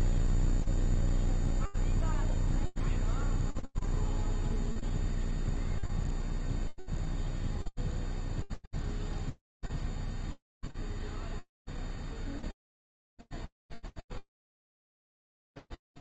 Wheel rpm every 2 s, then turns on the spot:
0, 0, 0, 0, 0, 0, 0, 0.
none